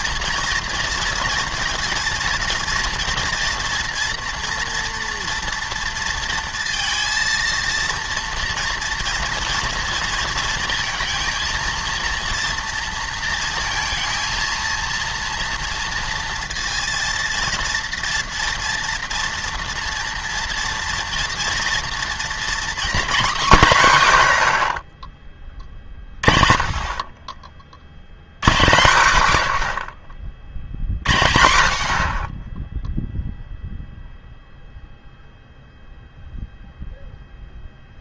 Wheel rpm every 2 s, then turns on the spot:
230, 230, 230, 230, 230, 230, 230, 230, 230, 230, 230, 250, 70, 40, 150, 70, 10, 0, 0.
none